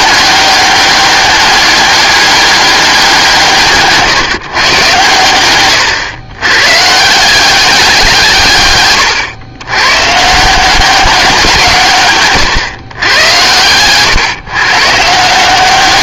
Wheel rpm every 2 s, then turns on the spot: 200, 200, 140, 120, 140, 170, 130, 130.
none